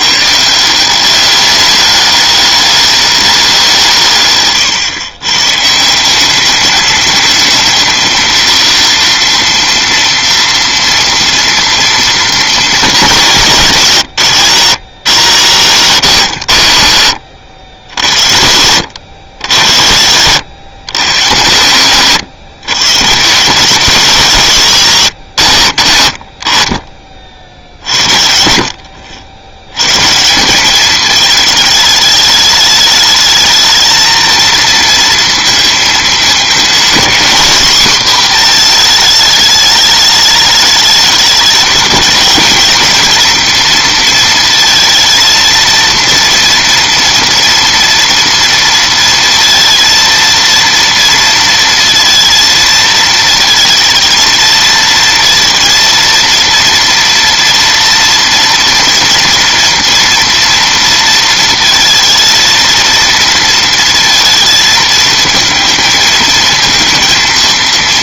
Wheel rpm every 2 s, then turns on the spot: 180, 210, 130, 200, 230, 230, 230, 150, 110, 100, 120, 120, 150, 30, 60, 210, 210, 230, 230, 230, 210, 230, 230, 230, 230, 230, 220, 230, 230, 230, 230, 230, 230, 230.
4-6